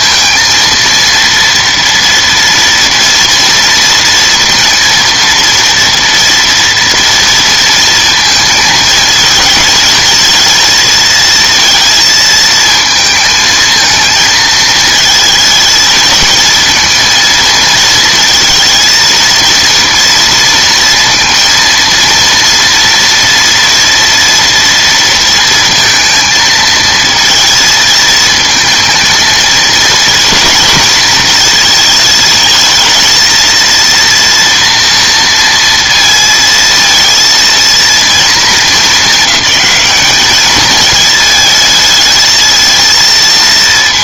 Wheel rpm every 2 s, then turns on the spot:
230, 230, 230, 230, 220, 230, 220, 220, 230, 230, 230, 240, 230, 230, 230, 220, 220, 230, 230, 200, 220, 230.
none